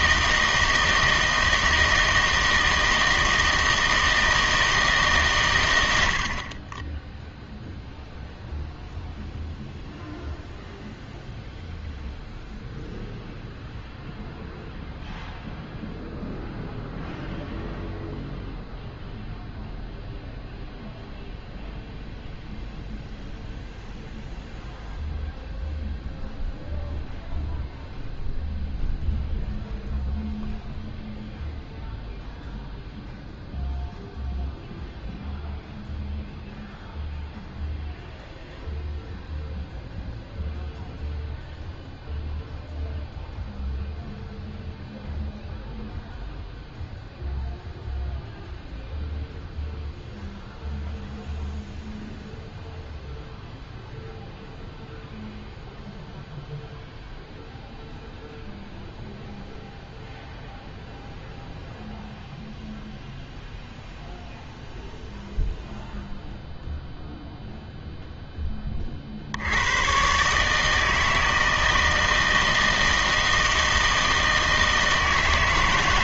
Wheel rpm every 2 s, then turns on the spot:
160, 160, 160, 30, 0, 0, 0, 0, 0, 0, 0, 0, 0, 0, 0, 0, 0, 0, 0, 0, 0, 0, 0, 0, 0, 0, 0, 0, 0, 0, 0, 0, 0, 0, 10, 150, 160, 160.
none